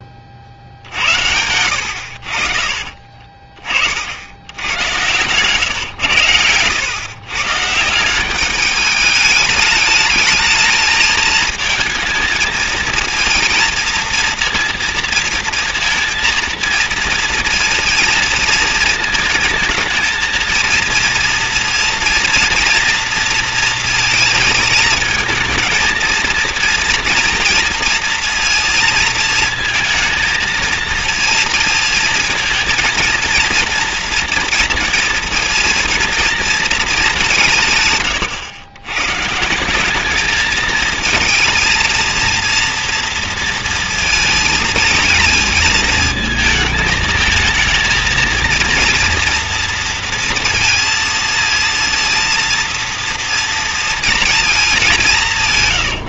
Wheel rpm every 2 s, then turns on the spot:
60, 50, 90, 110, 200, 220, 220, 230, 230, 220, 230, 230, 220, 230, 230, 220, 230, 230, 230, 110, 220, 230, 220, 220, 230, 230, 230, 220.
2-4